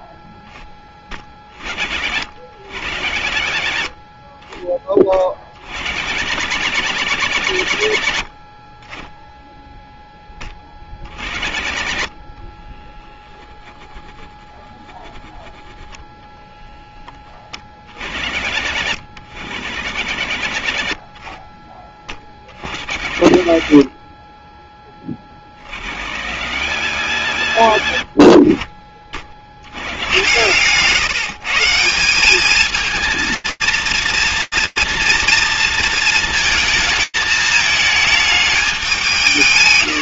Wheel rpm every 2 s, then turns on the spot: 20, 60, 20, 110, 30, 30, 20, 10, 0, 70, 50, 40, 10, 90, 30, 120, 220, 230, 220, 210.
30-32